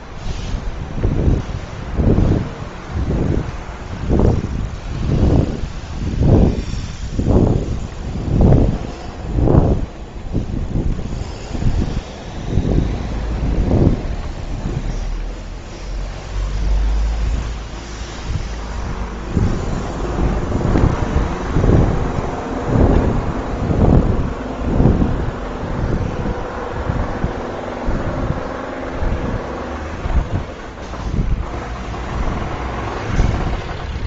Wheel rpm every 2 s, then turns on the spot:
0, 0, 0, 0, 0, 0, 0, 0, 0, 0, 0, 0, 0, 0, 0, 0, 0.
none